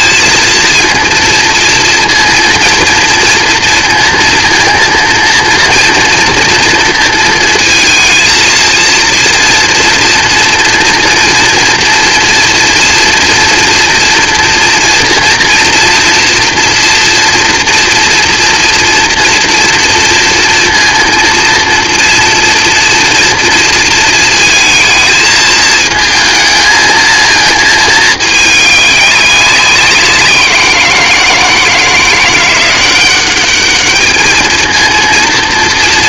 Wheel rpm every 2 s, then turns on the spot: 220, 230, 230, 230, 230, 240, 230, 230, 230, 230, 230, 230, 230, 230, 210, 180, 180, 220.
none